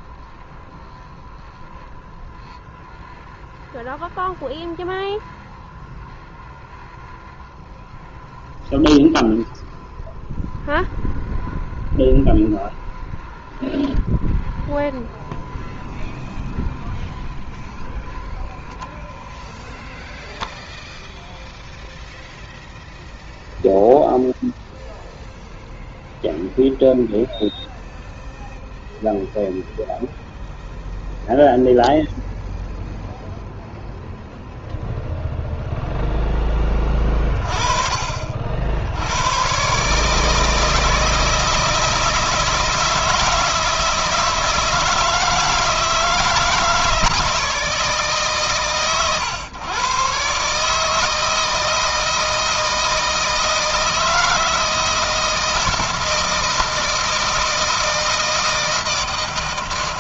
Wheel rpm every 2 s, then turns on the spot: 0, 0, 0, 0, 0, 0, 0, 0, 0, 0, 0, 0, 0, 0, 0, 0, 0, 0, 20, 70, 160, 160, 160, 160, 120, 160, 160, 160, 160, 160.
none